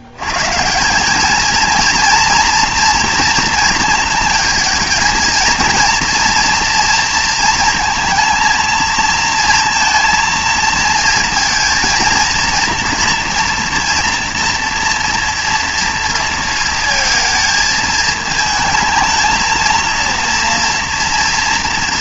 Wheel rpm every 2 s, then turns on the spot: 160, 230, 230, 230, 230, 230, 230, 230, 230, 220, 230.
none